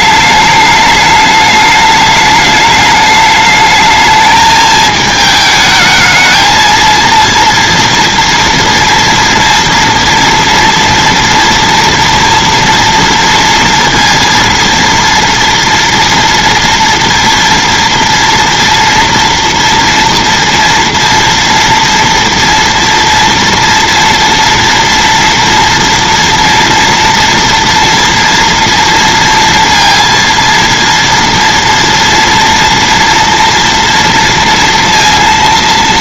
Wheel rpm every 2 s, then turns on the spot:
210, 210, 220, 220, 230, 230, 230, 230, 230, 230, 230, 230, 230, 230, 230, 230, 230, 230.
none